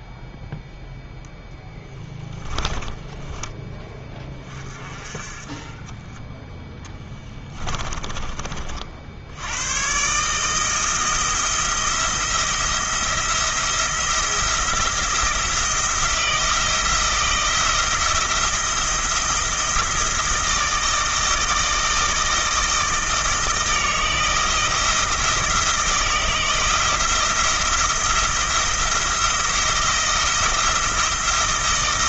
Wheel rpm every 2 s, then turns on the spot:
0, 20, 30, 10, 50, 160, 170, 170, 170, 170, 160, 160, 160, 170, 170, 170.
2-4 6-8